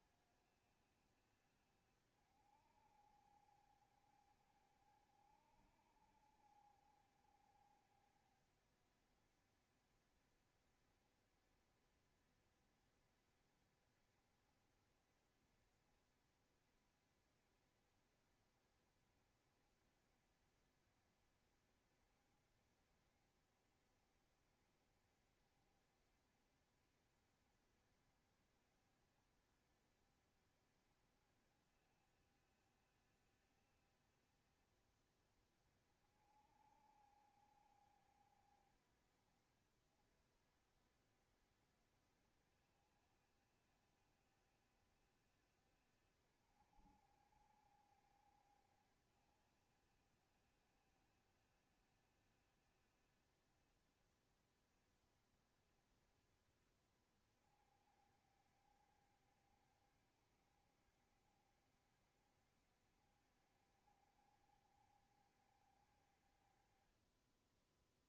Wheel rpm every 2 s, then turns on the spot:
70, 60, 60, 60, 60, 70, 70, 70, 70, 70, 60, 70, 70, 70, 70, 70, 70, 70, 70, 50, 60, 60, 60, 60, 60, 70, 70, 70, 60, 70, 70, 70, 60, 20.
none